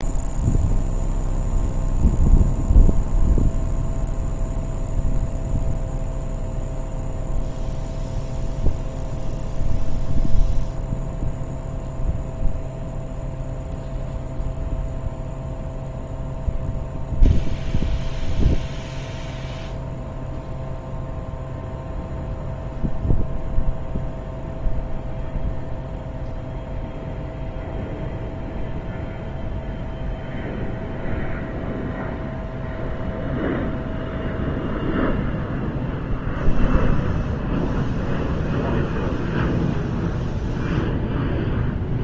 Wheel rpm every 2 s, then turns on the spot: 0, 0, 0, 0, 0, 0, 0, 0, 0, 0, 0, 0, 0, 0, 0, 0, 0, 0, 0, 0, 0.
none